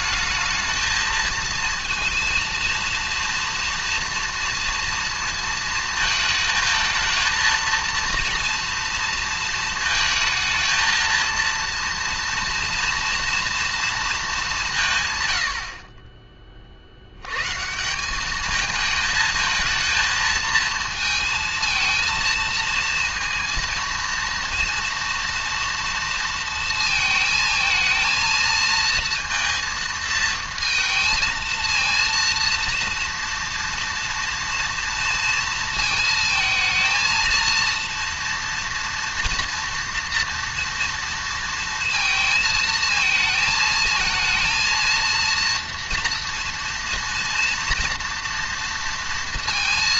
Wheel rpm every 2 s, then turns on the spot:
220, 230, 230, 220, 230, 220, 230, 190, 40, 210, 220, 220, 230, 230, 230, 220, 230, 230, 220, 230, 230, 220, 230, 230, 230.
none